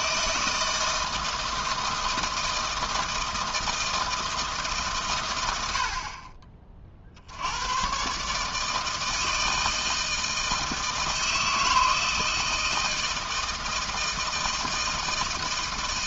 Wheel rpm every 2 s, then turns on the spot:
160, 160, 150, 40, 150, 160, 160, 160.
none